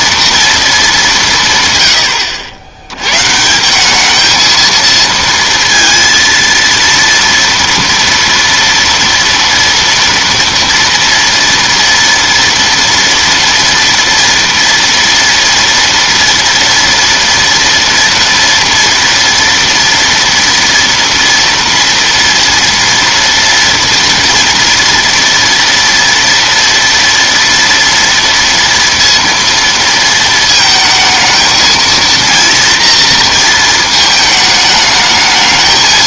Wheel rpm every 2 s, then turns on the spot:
220, 90, 230, 230, 230, 230, 230, 230, 230, 230, 230, 230, 240, 230, 230, 220, 230, 220.
none